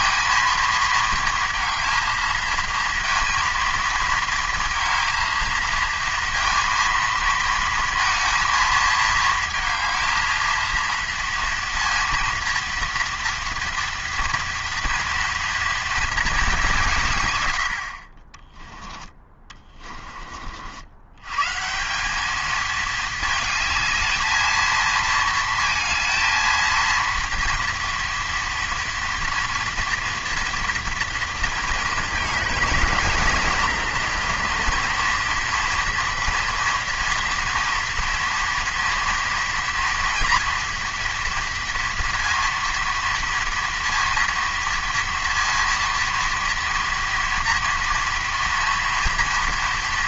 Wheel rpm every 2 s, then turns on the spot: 230, 230, 220, 230, 230, 230, 230, 230, 180, 20, 60, 220, 220, 230, 240, 240, 230, 230, 230, 230, 240, 230, 230, 230, 230.
none